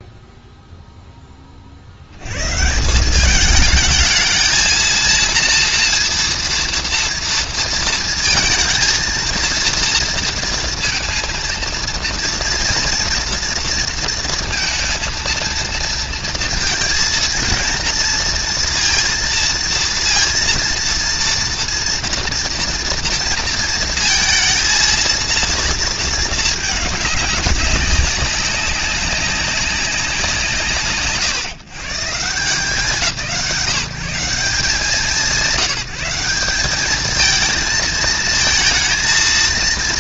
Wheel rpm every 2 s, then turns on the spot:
0, 80, 220, 230, 230, 230, 230, 230, 230, 230, 230, 230, 230, 220, 200, 180, 130, 150, 180, 220.
none